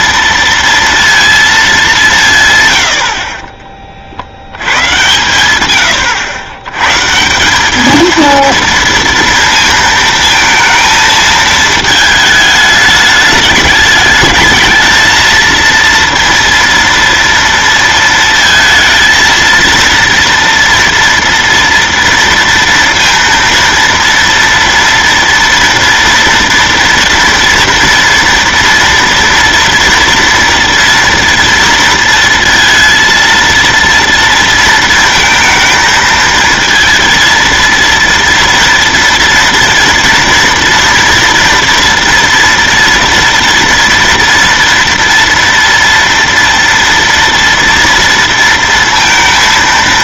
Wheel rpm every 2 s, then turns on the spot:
230, 100, 110, 120, 230, 220, 210, 220, 230, 230, 230, 230, 230, 230, 230, 230, 230, 230, 230, 230, 230, 240, 240, 230, 230.
none